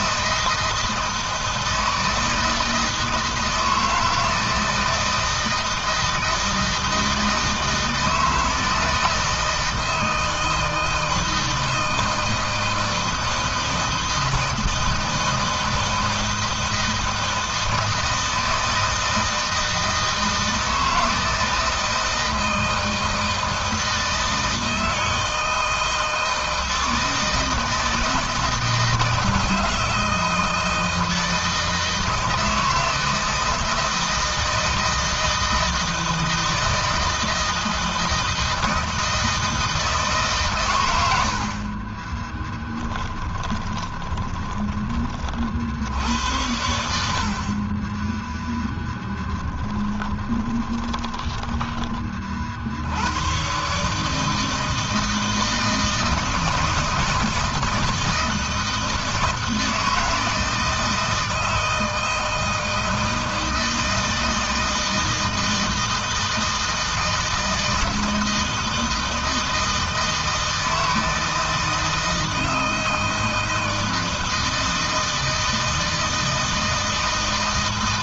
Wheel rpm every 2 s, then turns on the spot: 160, 160, 160, 160, 160, 160, 160, 160, 160, 160, 160, 160, 160, 160, 160, 160, 160, 160, 160, 160, 120, 10, 20, 80, 10, 20, 60, 160, 160, 160, 160, 160, 160, 160, 160, 160, 160, 160, 160.
42-44 50-52